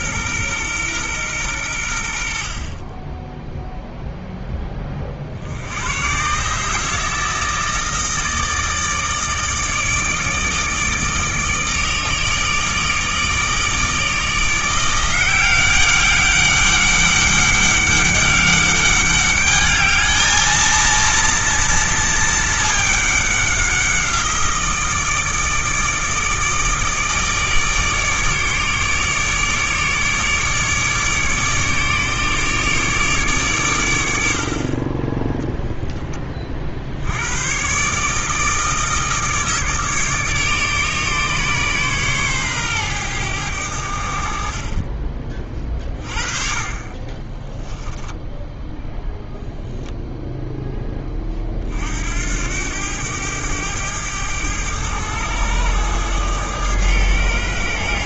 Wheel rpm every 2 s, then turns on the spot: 120, 30, 30, 150, 160, 150, 160, 170, 200, 200, 230, 210, 160, 160, 150, 150, 150, 40, 70, 160, 150, 120, 30, 20, 0, 10, 100, 100, 110.
none